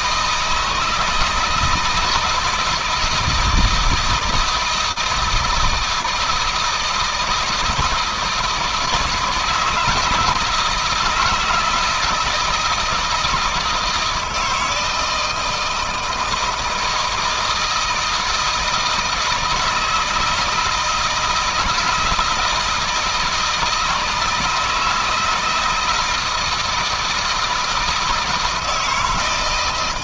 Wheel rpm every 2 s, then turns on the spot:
160, 160, 160, 160, 160, 160, 160, 160, 160, 160, 170, 170, 160, 160, 160.
none